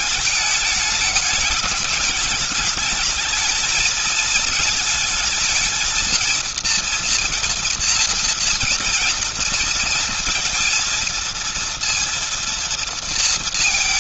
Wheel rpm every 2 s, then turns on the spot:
220, 210, 220, 230, 230, 230, 230.
none